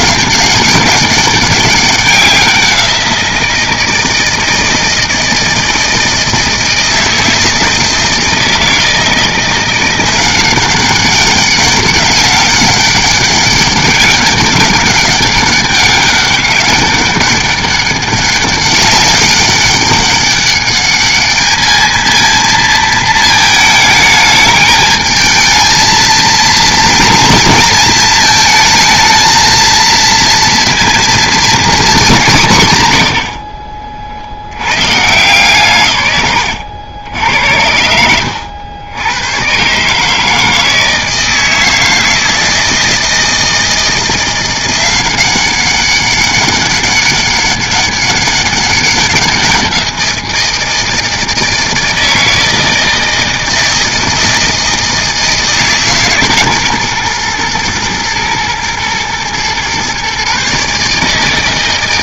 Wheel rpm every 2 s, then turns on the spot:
190, 180, 160, 160, 160, 190, 200, 200, 200, 200, 200, 230, 220, 230, 220, 230, 150, 100, 100, 90, 160, 160, 180, 200, 200, 170, 160, 160, 130, 110, 150.
none